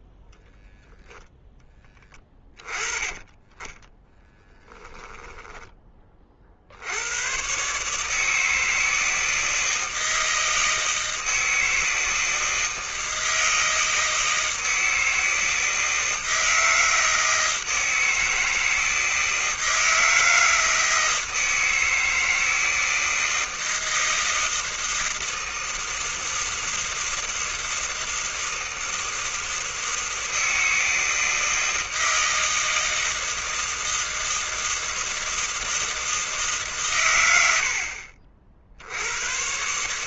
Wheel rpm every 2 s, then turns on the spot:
0, 30, 10, 80, 160, 160, 160, 160, 160, 160, 160, 160, 160, 160, 160, 160, 160, 160, 120, 90.
4-6